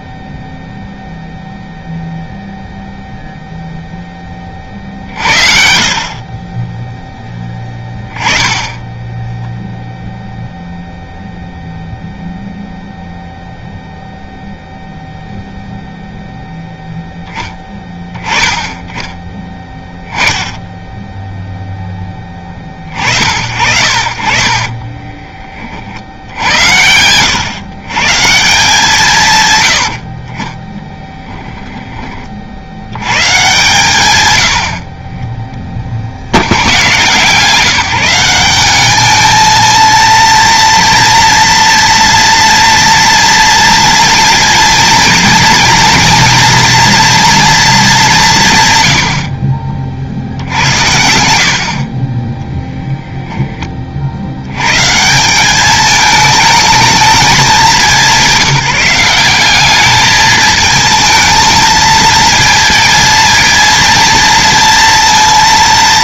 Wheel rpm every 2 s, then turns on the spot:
0, 0, 50, 10, 20, 0, 0, 0, 0, 10, 10, 40, 20, 100, 150, 10, 80, 50, 120, 210, 230, 230, 230, 230, 100, 80, 0, 140, 220, 180, 220, 230, 230.
24-26 30-32